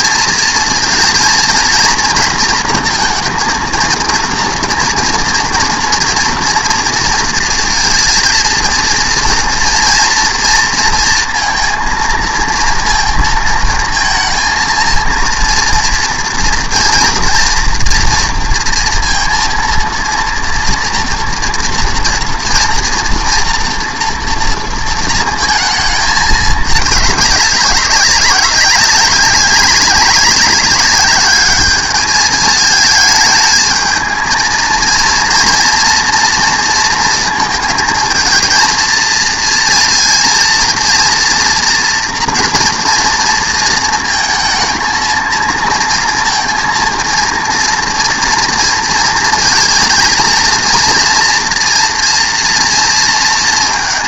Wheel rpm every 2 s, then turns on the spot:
230, 230, 230, 230, 230, 230, 230, 230, 230, 230, 230, 230, 230, 210, 200, 200, 210, 230, 230, 220, 230, 230, 230, 230, 230, 230, 230.
none